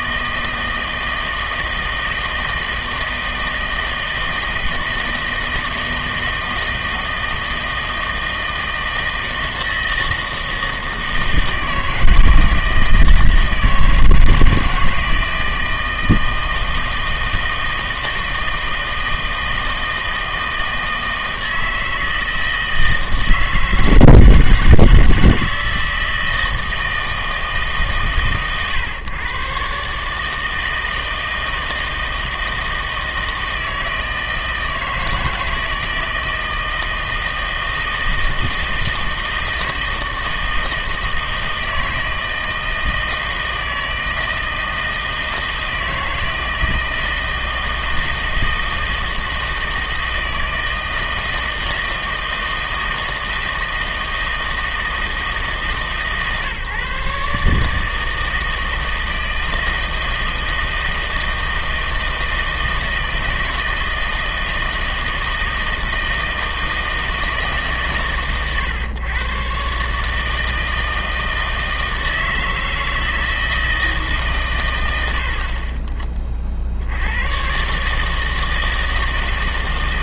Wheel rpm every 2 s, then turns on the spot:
160, 160, 160, 160, 160, 160, 160, 160, 160, 160, 160, 160, 160, 160, 130, 160, 160, 160, 160, 160, 160, 160, 160, 160, 160, 160, 160, 160, 140, 160, 160, 160, 160, 160, 120, 160, 160, 100, 70, 160.
none